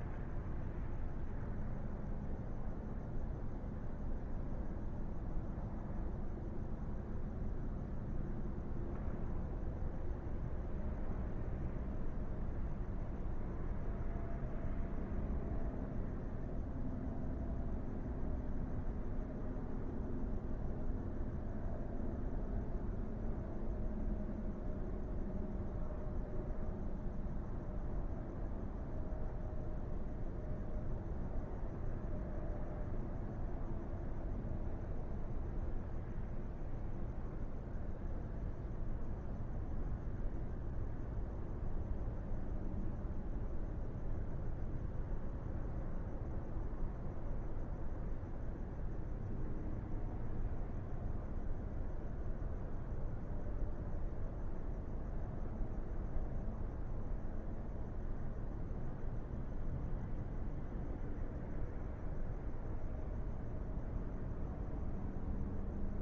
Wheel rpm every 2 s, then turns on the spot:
0, 0, 0, 0, 0, 0, 0, 0, 0, 0, 0, 0, 0, 0, 0, 0, 0, 0, 0, 0, 0, 0, 0, 0, 0, 0, 0, 0, 0, 0, 0, 0, 0.
none